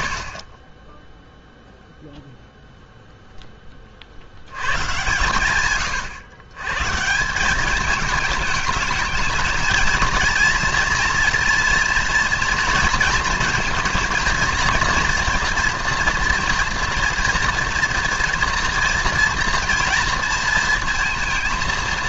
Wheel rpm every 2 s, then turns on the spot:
20, 0, 100, 130, 210, 230, 230, 230, 230, 230, 230.
none